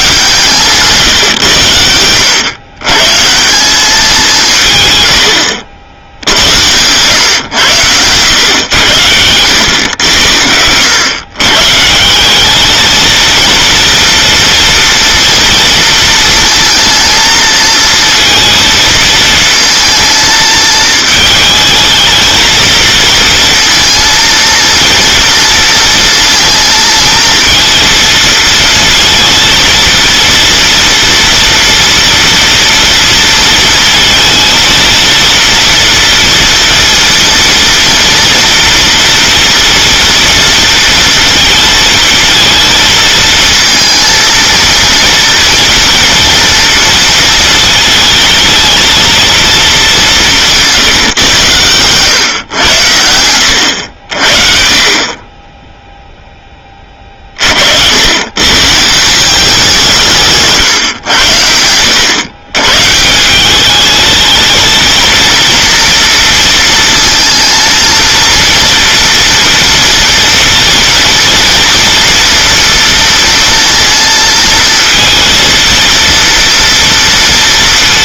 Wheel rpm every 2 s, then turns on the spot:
150, 120, 130, 100, 110, 100, 210, 230, 230, 220, 220, 220, 230, 230, 230, 230, 230, 230, 230, 230, 230, 230, 230, 230, 220, 160, 110, 40, 20, 150, 140, 140, 230, 230, 230, 230, 230, 230, 230.
none